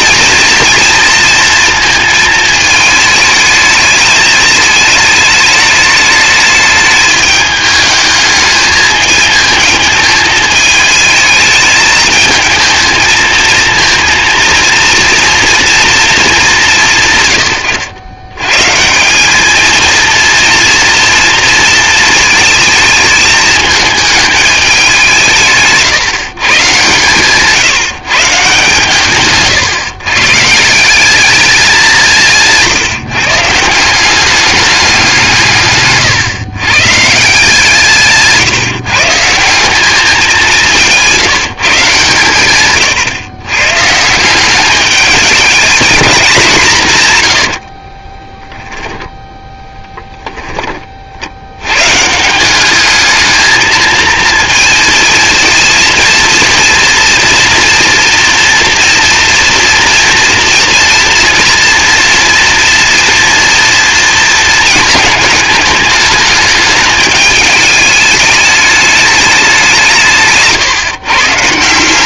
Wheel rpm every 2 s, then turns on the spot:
230, 220, 210, 210, 220, 220, 220, 230, 120, 200, 230, 220, 170, 140, 140, 200, 150, 170, 150, 160, 170, 110, 210, 110, 10, 50, 210, 220, 230, 230, 230, 230, 220, 210, 210, 140.
46-48